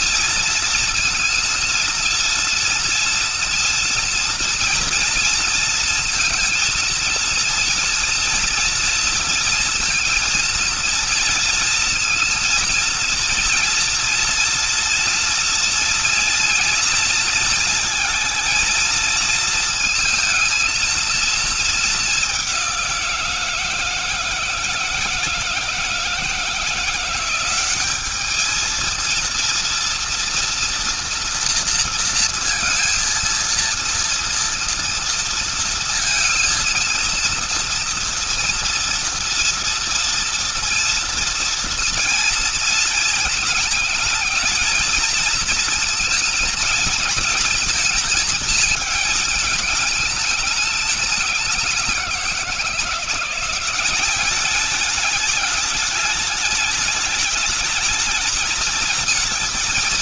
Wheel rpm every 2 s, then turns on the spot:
230, 230, 230, 230, 230, 230, 230, 230, 230, 230, 220, 190, 160, 170, 210, 230, 230, 230, 230, 230, 230, 230, 220, 230, 220, 210, 170, 210, 210, 210.
none